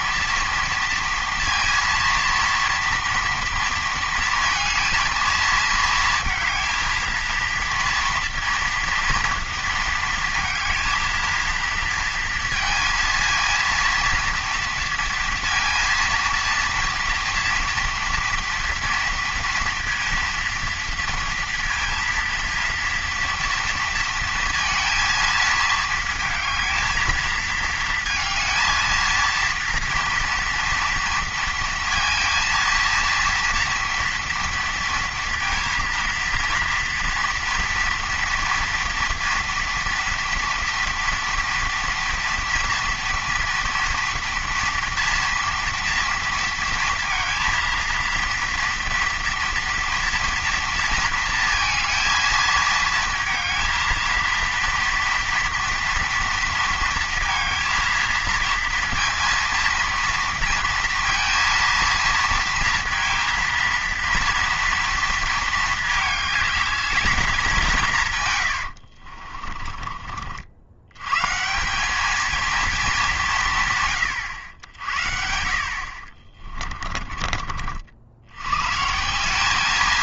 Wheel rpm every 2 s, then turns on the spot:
230, 230, 230, 220, 230, 230, 230, 230, 230, 230, 230, 230, 230, 220, 230, 230, 230, 230, 230, 230, 230, 240, 230, 230, 240, 230, 230, 230, 230, 230, 230, 230, 230, 210, 100, 80, 220, 80, 20, 120.
68-70 76-78